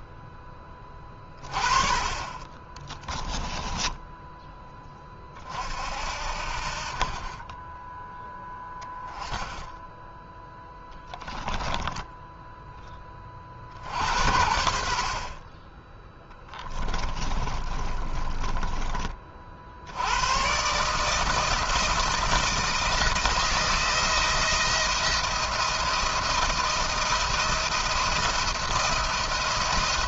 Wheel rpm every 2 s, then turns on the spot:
20, 20, 20, 40, 10, 0, 10, 60, 20, 20, 140, 160, 170, 160, 170.
2-4 16-18